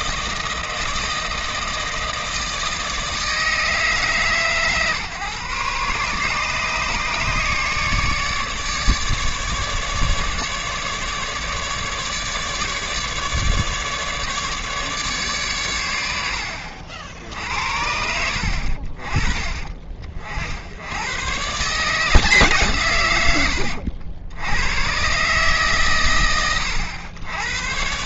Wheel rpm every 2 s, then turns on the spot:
160, 160, 130, 150, 150, 150, 150, 150, 70, 50, 80, 140, 100, 110.
none